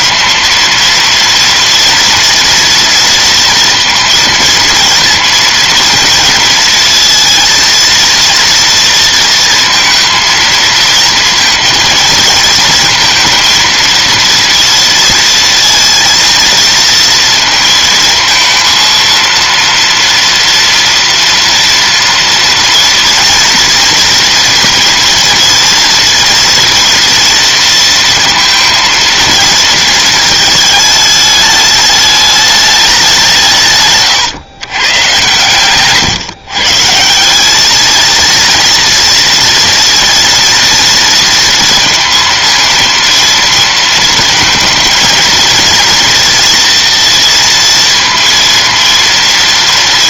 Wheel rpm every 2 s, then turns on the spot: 230, 230, 230, 230, 230, 230, 230, 230, 230, 230, 230, 230, 230, 230, 230, 210, 190, 120, 160, 230, 230, 230, 230, 230, 230.
none